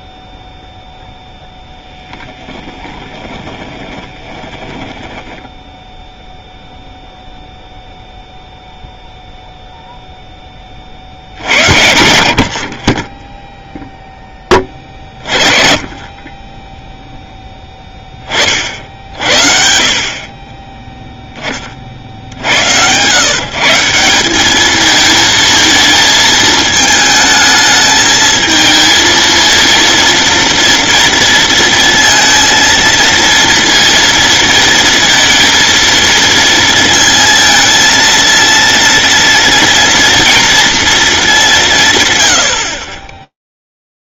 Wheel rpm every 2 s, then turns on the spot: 0, 10, 20, 0, 0, 30, 50, 20, 10, 50, 10, 90, 220, 220, 220, 230, 230, 230, 230, 230, 230, 30.
2-6